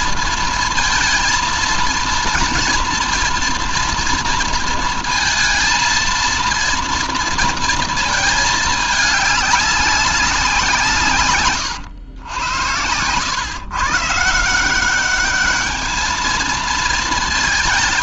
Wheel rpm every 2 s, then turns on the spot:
230, 230, 230, 230, 220, 170, 100, 180, 230.
none